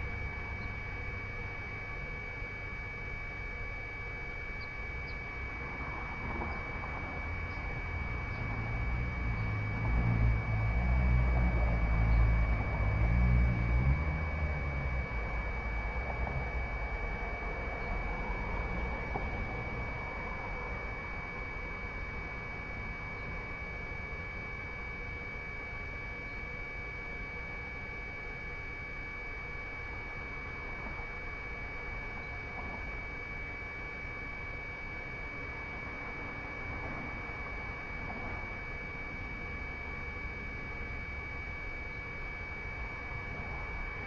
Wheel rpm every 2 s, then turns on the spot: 0, 0, 0, 0, 0, 0, 0, 0, 0, 0, 0, 0, 0, 0, 0, 0, 0, 0, 0, 0, 0, 0.
none